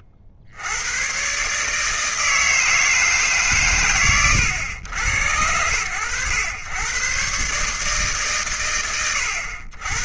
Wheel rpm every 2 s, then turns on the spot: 70, 160, 100, 120, 110.
none